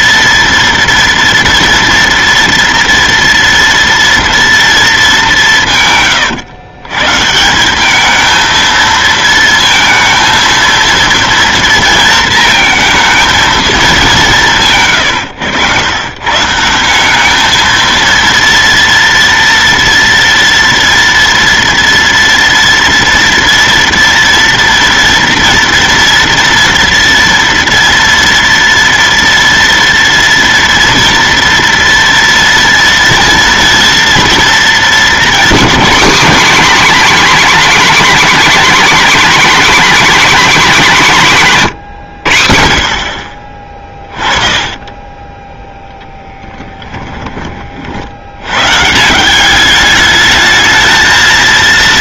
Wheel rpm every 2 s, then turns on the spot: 230, 230, 230, 130, 220, 230, 230, 190, 120, 230, 230, 230, 240, 230, 230, 230, 230, 230, 260, 270, 280, 80, 30, 10, 90, 220.
44-48